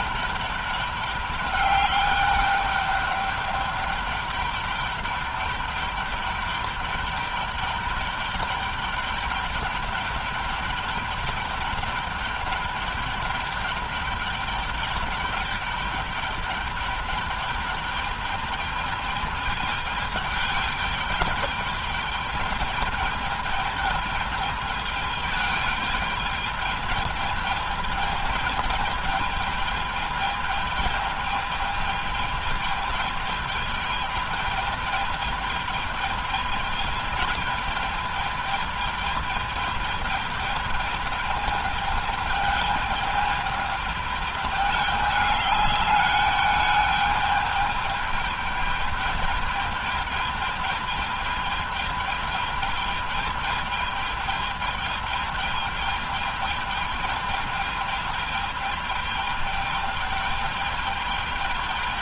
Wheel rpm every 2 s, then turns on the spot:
200, 200, 200, 200, 210, 210, 210, 200, 200, 210, 210, 210, 210, 210, 210, 210, 210, 210, 220, 210, 210, 210, 210, 210, 210, 210, 210, 210, 210, 210, 210.
none